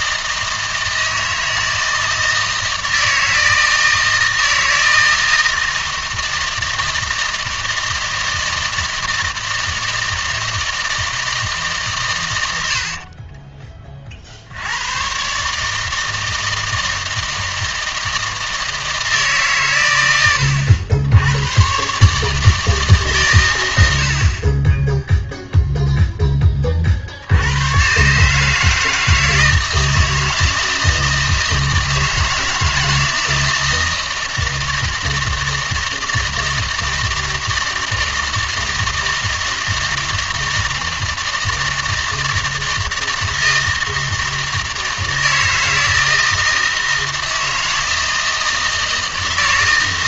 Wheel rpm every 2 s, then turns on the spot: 160, 160, 160, 160, 160, 160, 60, 90, 160, 160, 80, 150, 10, 40, 160, 160, 160, 160, 160, 160, 160, 160, 160, 160, 160.
12-14 24-26